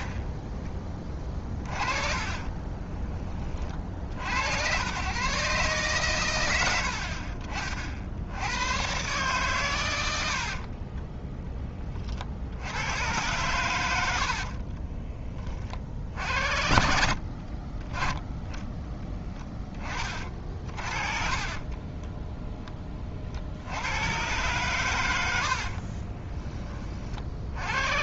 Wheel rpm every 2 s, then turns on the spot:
20, 30, 100, 80, 110, 40, 80, 30, 60, 10, 40, 20, 120, 30.
2-4 10-12 14-16 20-22